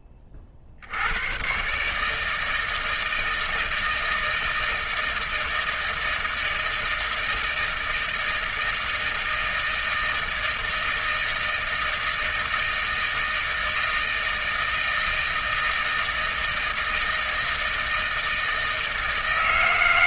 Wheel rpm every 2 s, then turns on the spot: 40, 160, 160, 160, 160, 160, 160, 160, 160, 160.
none